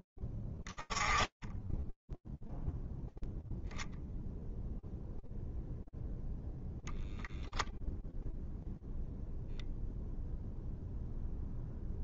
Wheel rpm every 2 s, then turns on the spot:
10, 0, 0, 0, 0, 0.
none